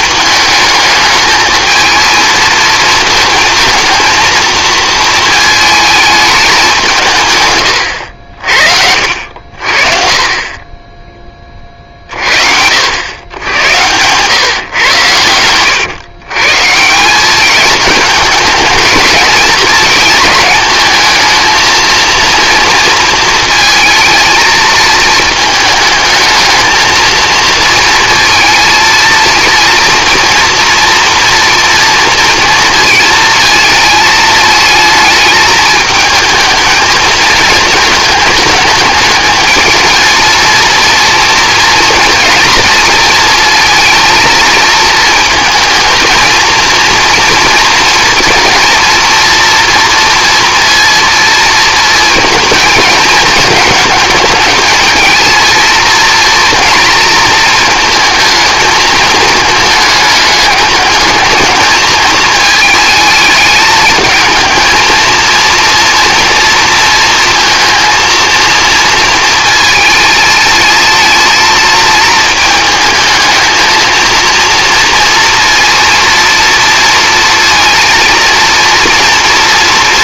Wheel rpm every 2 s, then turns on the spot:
210, 220, 230, 190, 60, 20, 70, 120, 140, 220, 220, 230, 220, 220, 230, 240, 230, 220, 230, 210, 230, 230, 220, 230, 230, 230, 220, 220, 230, 220, 210, 220, 220, 230, 230, 220, 220, 230, 230, 230.
none